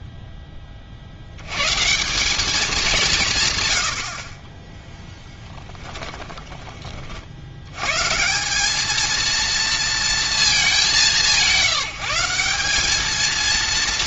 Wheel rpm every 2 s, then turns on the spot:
30, 200, 10, 20, 200, 210, 190.
4-6